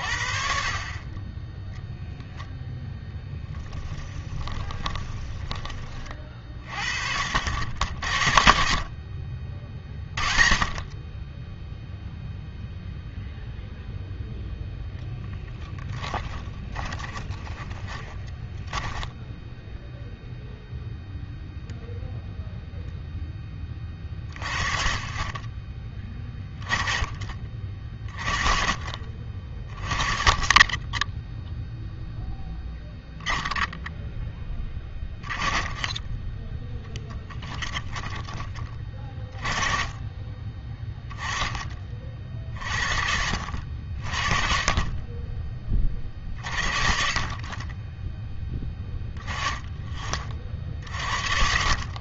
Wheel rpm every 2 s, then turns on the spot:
50, 0, 20, 50, 60, 50, 0, 0, 20, 10, 0, 0, 30, 20, 40, 20, 0, 10, 10, 20, 20, 50, 40, 40, 10, 40.
4-6 16-20